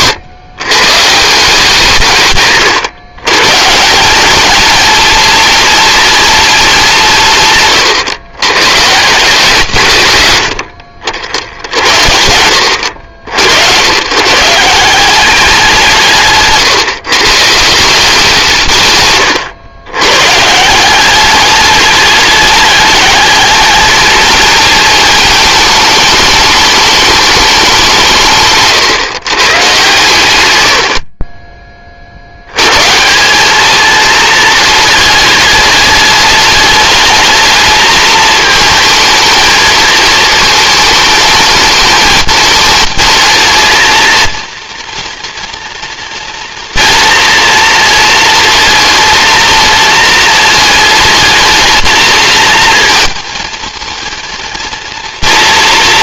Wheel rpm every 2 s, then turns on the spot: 150, 140, 240, 220, 140, 70, 70, 170, 140, 140, 170, 210, 230, 220, 140, 80, 140, 210, 210, 220, 220, 220, 230, 240, 230, 220, 230, 230.
30-32